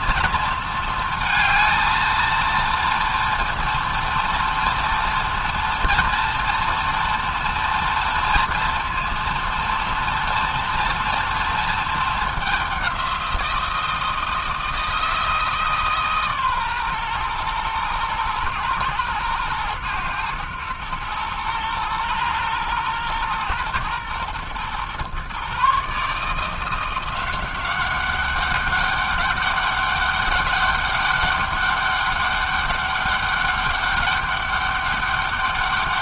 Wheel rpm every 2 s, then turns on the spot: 230, 230, 230, 230, 230, 230, 180, 160, 120, 120, 120, 120, 140, 180, 200, 200, 200, 200.
none